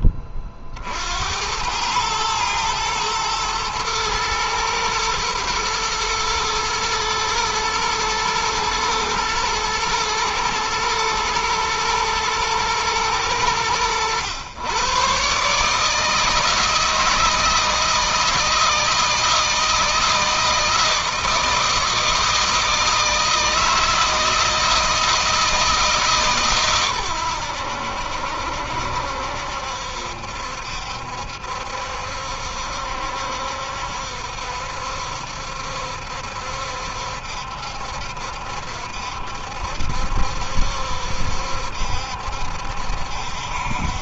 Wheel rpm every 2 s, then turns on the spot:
60, 120, 110, 110, 110, 110, 110, 130, 160, 160, 160, 160, 160, 120, 70, 70, 70, 70, 70, 70, 70, 70.
none